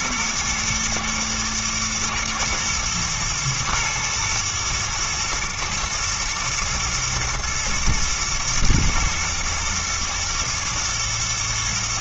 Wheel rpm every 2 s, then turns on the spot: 120, 110, 120, 110, 120, 110.
none